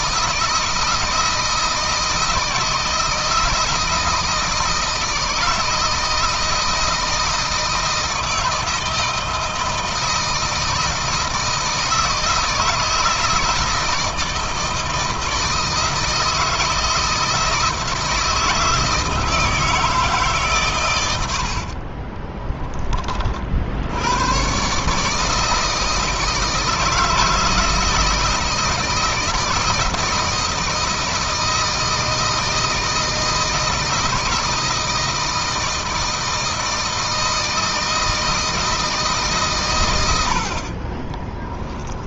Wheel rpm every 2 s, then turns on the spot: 160, 160, 160, 160, 160, 160, 160, 160, 160, 160, 120, 20, 130, 160, 160, 160, 160, 160, 160, 160, 60.
40-42